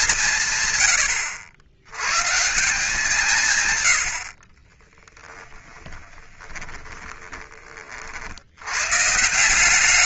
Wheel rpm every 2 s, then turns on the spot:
70, 90, 170, 20, 30.
6-8